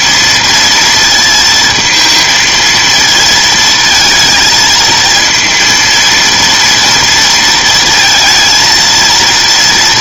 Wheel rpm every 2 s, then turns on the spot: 230, 220, 230, 230, 230.
none